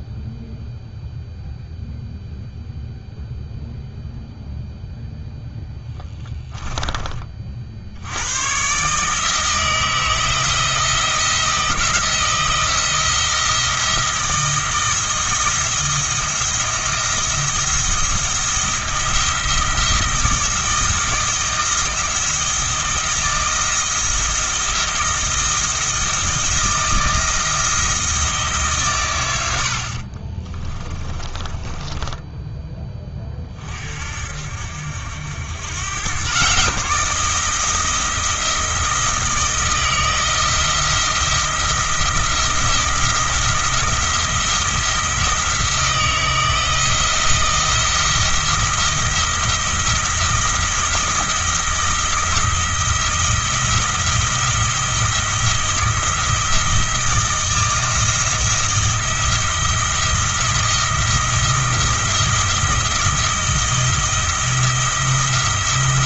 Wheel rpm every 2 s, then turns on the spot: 0, 0, 0, 10, 130, 170, 170, 170, 170, 170, 170, 170, 170, 160, 140, 20, 20, 70, 150, 160, 170, 170, 170, 170, 170, 170, 170, 170, 170, 170, 170, 170, 170.
30-32